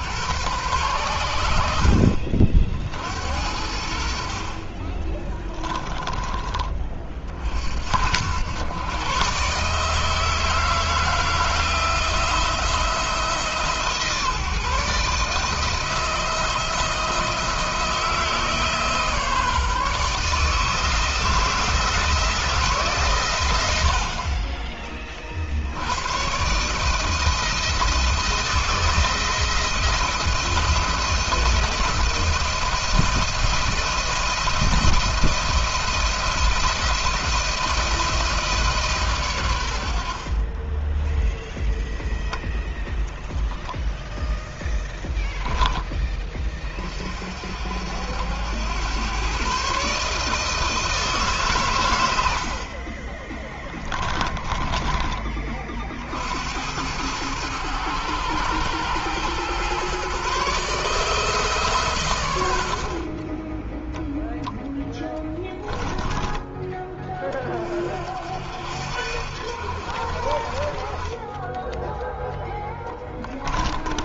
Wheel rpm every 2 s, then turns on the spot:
100, 50, 40, 30, 110, 160, 170, 150, 170, 160, 160, 160, 30, 140, 160, 170, 170, 170, 170, 150, 30, 0, 10, 30, 90, 150, 50, 20, 80, 110, 150, 80, 10, 10, 60, 30, 10.
40-42 54-56 64-66 72-74